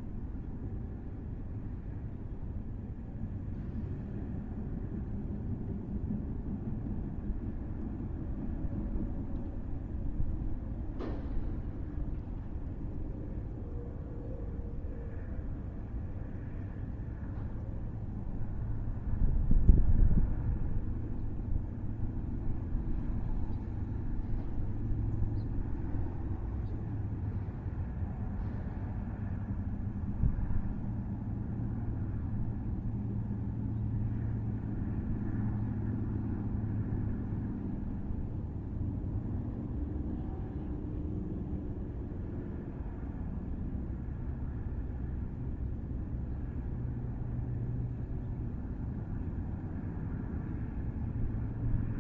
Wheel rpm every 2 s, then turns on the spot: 0, 0, 0, 0, 0, 0, 0, 0, 0, 0, 0, 0, 0, 0, 0, 0, 0, 0, 0, 0, 0, 0, 0, 0, 0, 0.
none